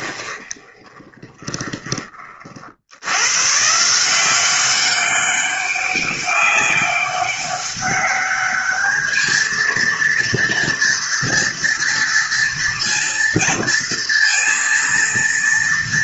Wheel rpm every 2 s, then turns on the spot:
20, 120, 200, 200, 220, 230, 230, 230.
0-2